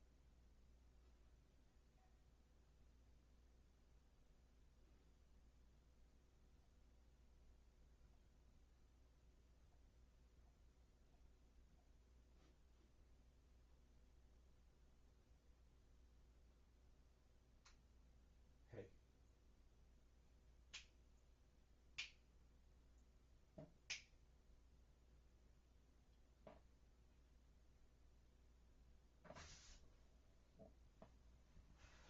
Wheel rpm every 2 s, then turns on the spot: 0, 0, 0, 0, 0, 0, 0, 0, 0, 0, 0, 0, 0, 0, 0, 0.
none